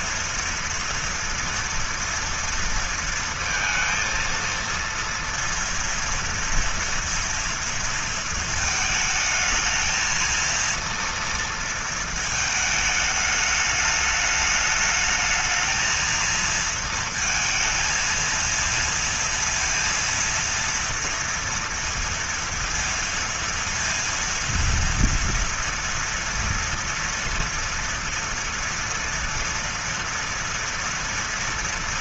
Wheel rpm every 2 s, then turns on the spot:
230, 230, 230, 230, 220, 230, 220, 210, 230, 230, 230, 230, 230, 230, 230, 230.
none